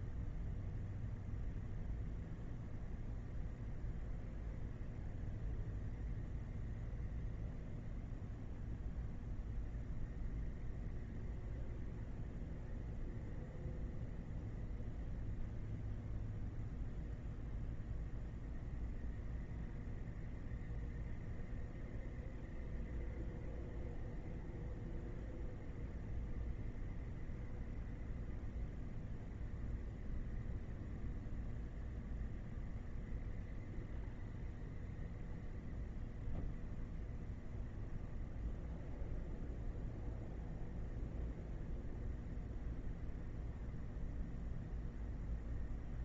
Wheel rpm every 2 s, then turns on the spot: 0, 0, 0, 0, 0, 0, 0, 0, 0, 0, 0, 0, 0, 0, 0, 0, 0, 0, 0, 0, 0, 0, 0.
none